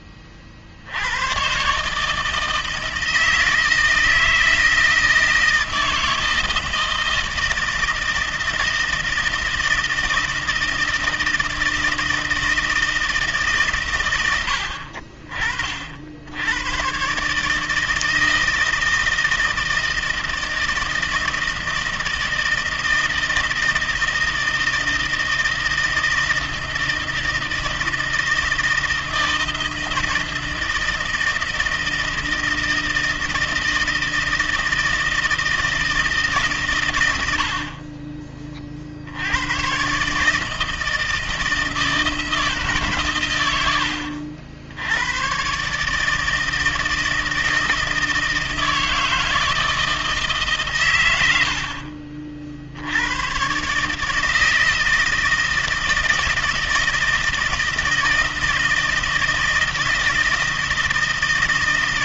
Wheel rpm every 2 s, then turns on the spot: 50, 160, 160, 160, 160, 160, 160, 90, 90, 160, 160, 160, 160, 160, 160, 160, 160, 160, 150, 40, 150, 150, 70, 160, 160, 140, 60, 160, 160, 160, 160.
none